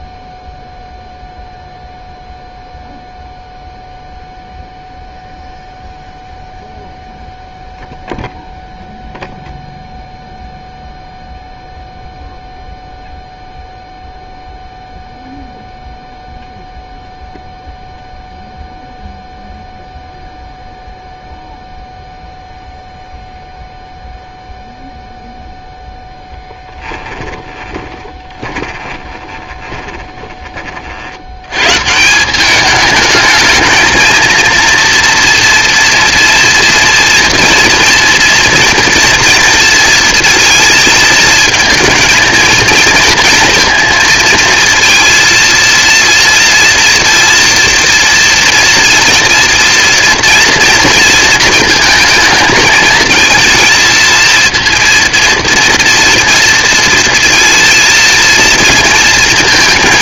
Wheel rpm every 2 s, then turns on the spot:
0, 0, 0, 0, 0, 0, 0, 0, 0, 0, 0, 0, 0, 10, 20, 40, 200, 230, 230, 230, 230, 230, 230, 230, 230, 240, 220, 230, 230, 230.
26-30